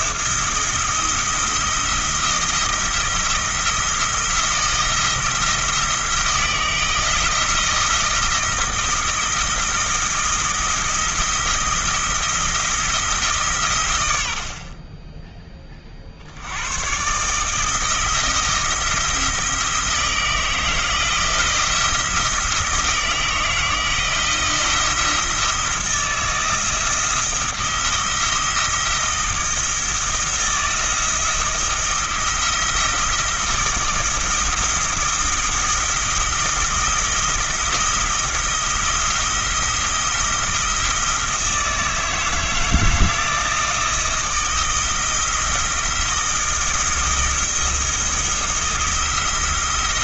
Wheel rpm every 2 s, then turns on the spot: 170, 170, 170, 170, 170, 170, 160, 30, 110, 160, 170, 170, 170, 170, 170, 170, 170, 170, 170, 170, 170, 160, 170, 160, 170.
none